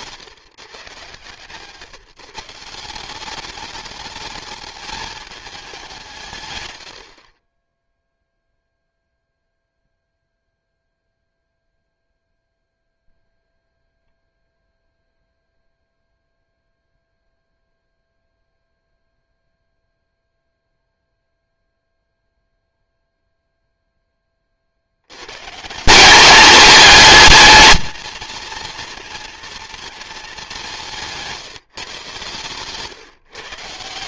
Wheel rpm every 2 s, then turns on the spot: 140, 160, 220, 110, 0, 0, 0, 0, 0, 0, 0, 0, 60, 210, 230, 180, 140.
none